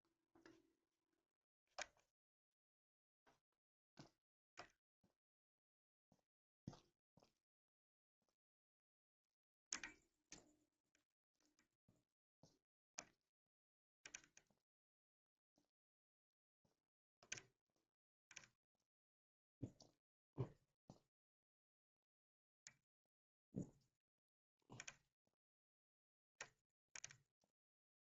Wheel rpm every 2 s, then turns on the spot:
0, 0, 0, 0, 0, 0, 0, 0, 0, 0, 0, 0, 0, 0.
none